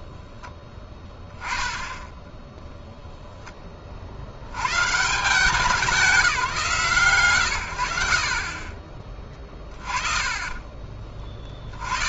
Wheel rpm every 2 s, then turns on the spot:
10, 110, 150, 30, 20, 130.
none